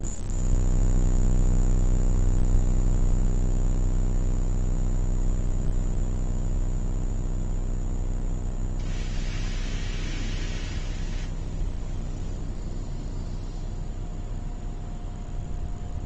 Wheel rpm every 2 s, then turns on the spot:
0, 0, 0, 0, 0, 0, 0, 0.
none